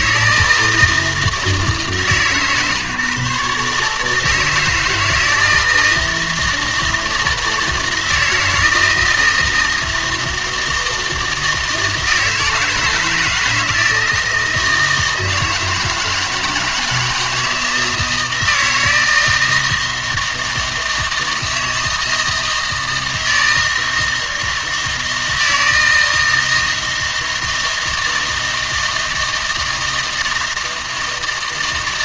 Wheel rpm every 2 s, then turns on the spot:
160, 140, 160, 160, 160, 160, 160, 160, 160, 160, 160, 160, 160, 160, 160, 160.
none